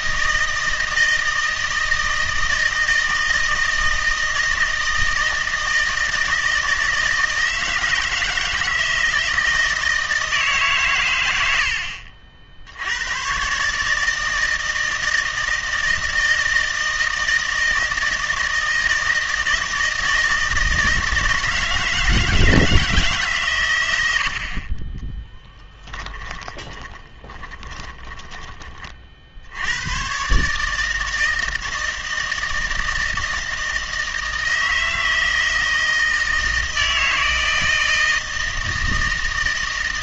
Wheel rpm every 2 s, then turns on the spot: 160, 160, 160, 160, 160, 140, 80, 160, 160, 160, 160, 160, 40, 30, 30, 150, 160, 160, 160, 160.
26-28